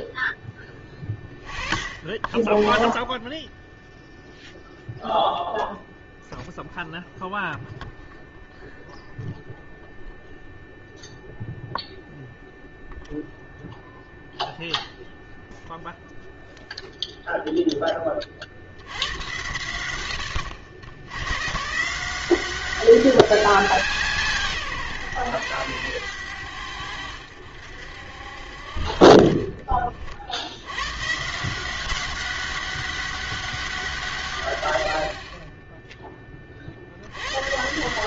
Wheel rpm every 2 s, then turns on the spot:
10, 20, 0, 0, 0, 0, 0, 0, 0, 60, 70, 190, 140, 90, 50, 80, 200, 110, 40.
none